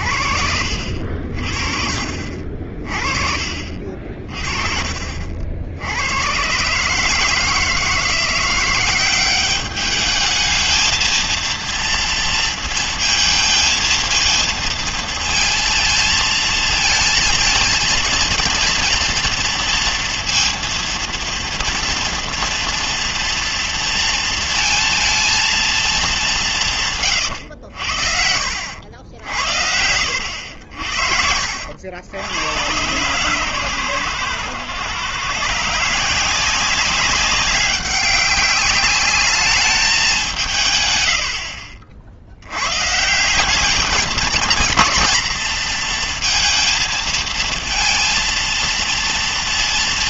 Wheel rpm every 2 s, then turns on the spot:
60, 40, 40, 130, 180, 220, 230, 230, 230, 230, 230, 230, 230, 190, 70, 80, 110, 120, 180, 200, 150, 90, 220, 230, 230.
2-4 28-32